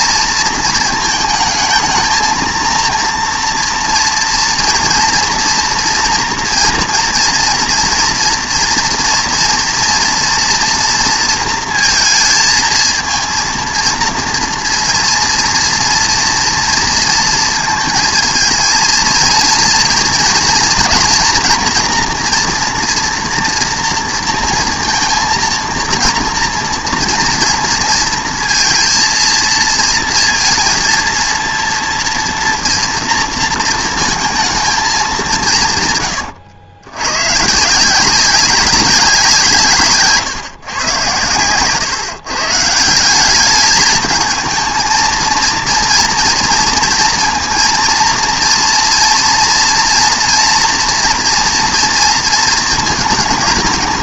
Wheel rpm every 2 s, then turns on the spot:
220, 230, 240, 230, 230, 230, 230, 230, 230, 230, 230, 230, 230, 230, 230, 230, 230, 220, 100, 190, 120, 160, 220, 230, 230, 230, 220.
none